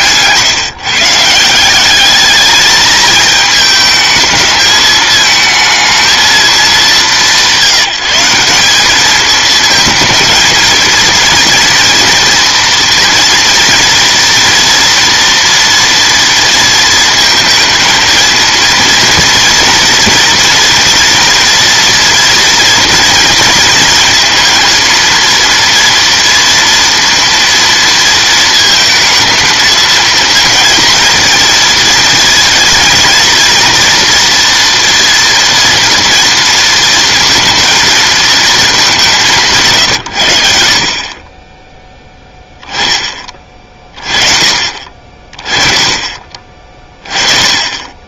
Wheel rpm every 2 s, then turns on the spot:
150, 210, 220, 220, 200, 220, 230, 230, 230, 230, 230, 230, 230, 230, 220, 230, 230, 240, 230, 210, 60, 10, 40, 30.
none